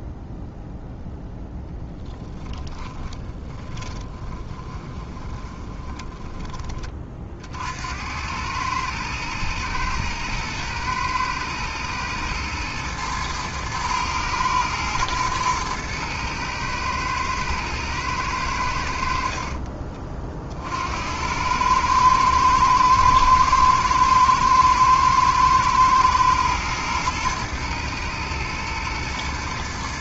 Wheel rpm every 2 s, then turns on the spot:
0, 20, 30, 30, 110, 110, 110, 110, 110, 70, 70, 120, 110, 120, 120.
2-6